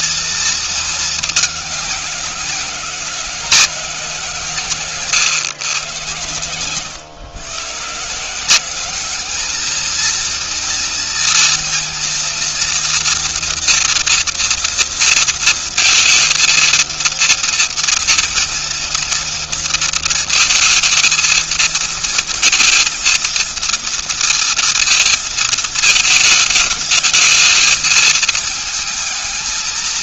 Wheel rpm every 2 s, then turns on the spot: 180, 140, 120, 180, 230, 230, 230, 230, 230, 230, 230, 230, 220, 220, 210.
none